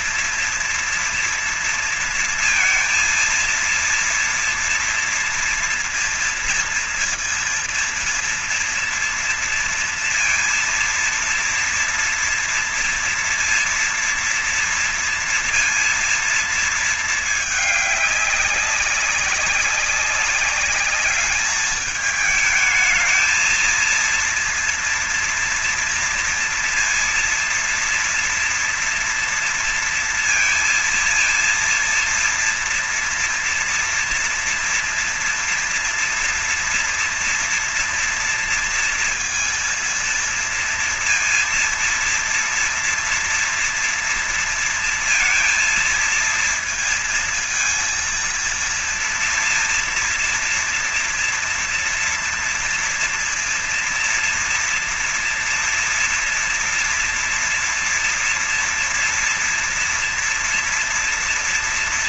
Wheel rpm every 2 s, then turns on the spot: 230, 230, 230, 230, 230, 230, 230, 230, 220, 200, 200, 220, 230, 230, 230, 230, 230, 240, 230, 230, 230, 230, 230, 220, 230, 240, 240, 230, 240, 230, 230.
none